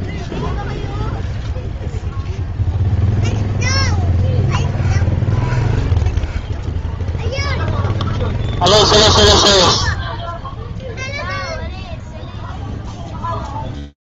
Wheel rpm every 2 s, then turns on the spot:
0, 0, 0, 0, 0, 0, 0.
none